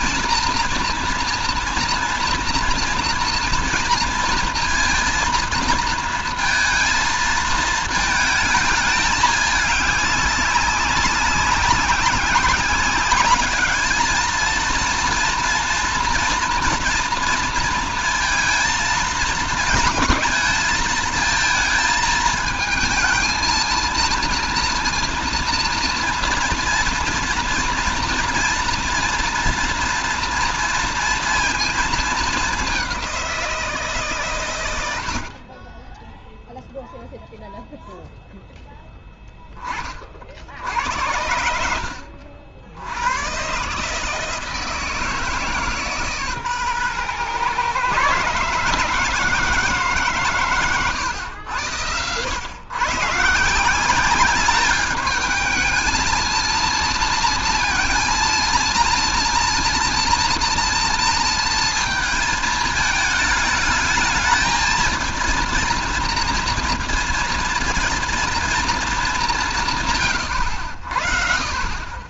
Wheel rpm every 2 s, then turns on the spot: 230, 230, 230, 230, 220, 200, 200, 220, 230, 230, 220, 220, 230, 230, 240, 230, 210, 110, 0, 0, 70, 70, 160, 130, 150, 120, 120, 210, 230, 230, 230, 220, 220, 230, 230, 80.
none